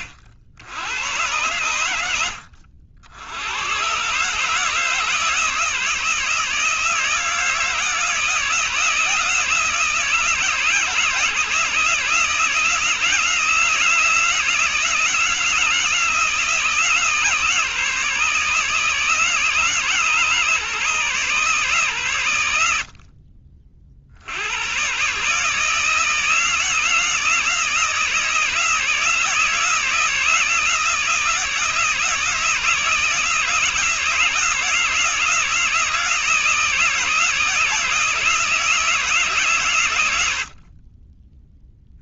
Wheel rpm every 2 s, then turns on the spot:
100, 80, 160, 160, 160, 160, 160, 160, 160, 150, 140, 60, 120, 160, 160, 160, 160, 160, 160, 160, 30.
none